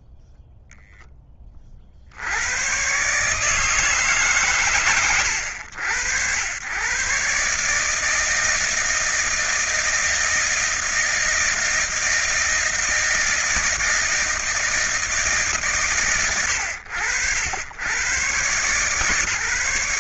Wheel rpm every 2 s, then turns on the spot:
10, 140, 100, 120, 160, 160, 160, 160, 80, 140.
none